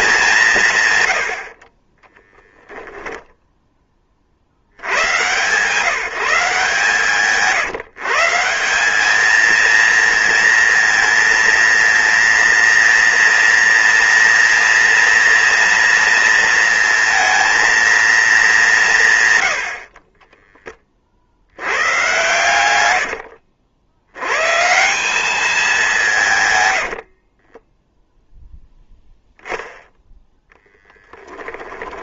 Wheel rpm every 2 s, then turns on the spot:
140, 0, 90, 150, 190, 230, 230, 230, 230, 180, 20, 100, 160, 80, 0, 10.
22-24 26-28